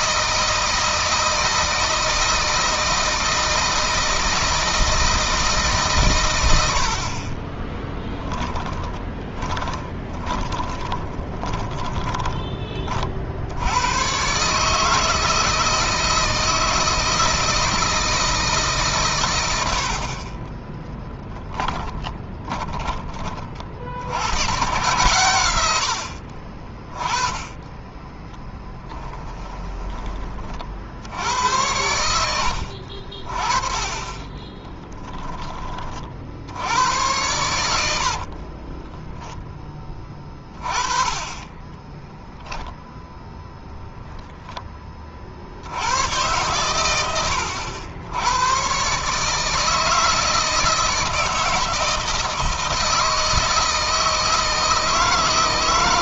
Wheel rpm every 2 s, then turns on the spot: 160, 160, 160, 90, 10, 20, 20, 140, 160, 150, 20, 20, 110, 50, 10, 50, 70, 30, 80, 40, 20, 0, 10, 120, 120, 160, 160, 160.
8-12 20-24 28-30 34-36 38-40